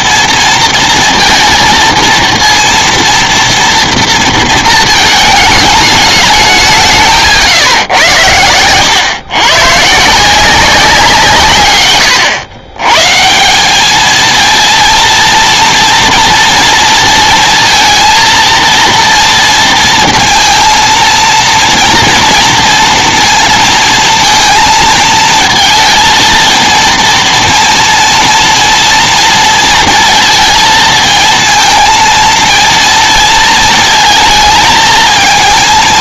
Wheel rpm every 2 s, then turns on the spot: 230, 230, 230, 210, 110, 150, 110, 220, 230, 230, 230, 230, 230, 230, 230, 230, 230, 220.
none